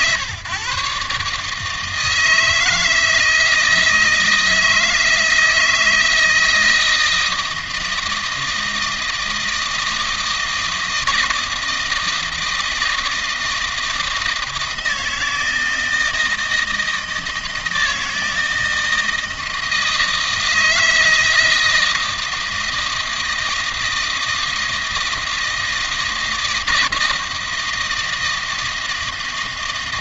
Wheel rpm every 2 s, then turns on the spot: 130, 160, 160, 160, 160, 160, 160, 160, 160, 160, 160, 160, 160, 160, 160.
none